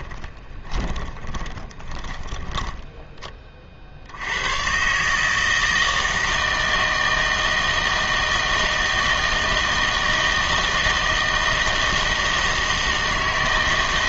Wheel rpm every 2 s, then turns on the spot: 20, 10, 120, 160, 160, 160, 160.
0-4